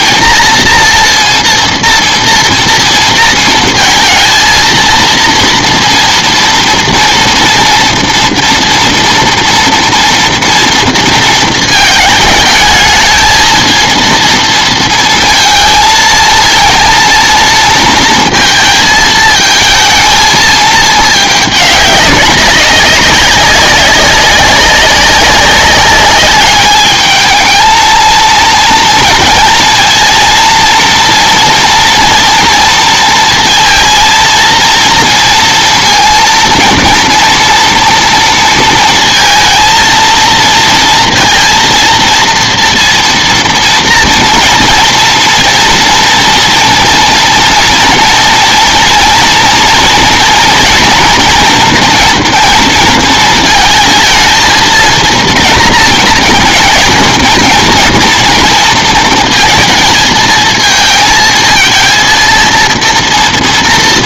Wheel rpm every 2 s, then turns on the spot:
230, 230, 230, 230, 230, 230, 220, 230, 230, 230, 220, 200, 190, 210, 230, 230, 230, 230, 230, 230, 230, 230, 230, 230, 230, 230, 230, 230, 230, 230, 220, 230.
none